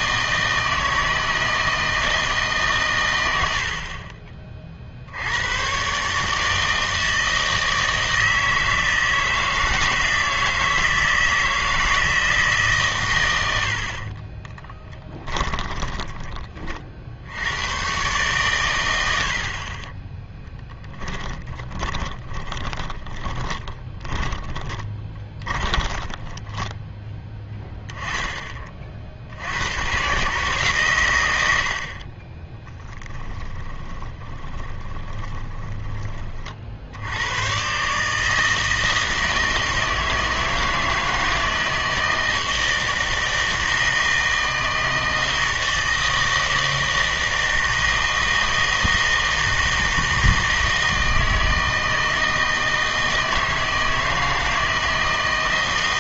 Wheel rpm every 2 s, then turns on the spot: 160, 150, 40, 160, 160, 160, 150, 20, 30, 110, 10, 20, 20, 10, 30, 140, 20, 20, 50, 160, 160, 160, 160, 160, 160, 160, 160, 160.
14-16 20-28 32-36